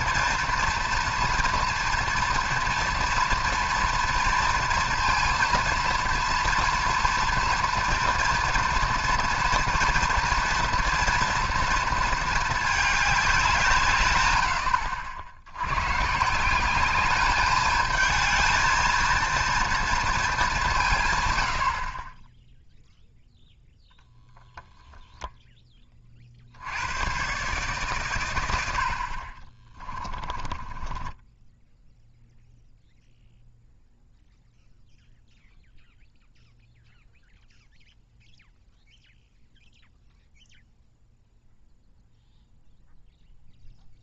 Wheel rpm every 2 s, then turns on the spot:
240, 230, 230, 230, 240, 230, 210, 80, 190, 220, 180, 0, 20, 70, 90, 10, 0, 0, 0, 0, 0, 0.
30-32